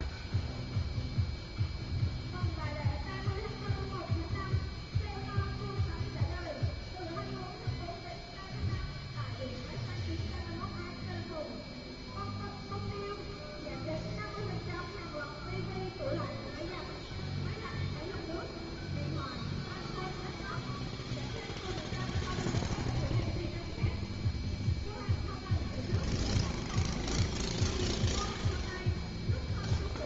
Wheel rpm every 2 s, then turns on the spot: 0, 0, 0, 0, 0, 0, 0, 0, 0, 0, 0, 0, 0, 0, 0.
none